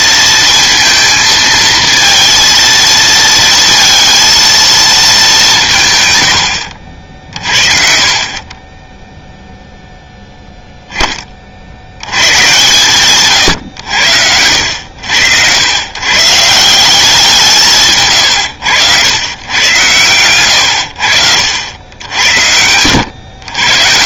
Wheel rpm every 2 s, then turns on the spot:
230, 230, 230, 80, 20, 0, 120, 80, 160, 90, 100, 90.
18-20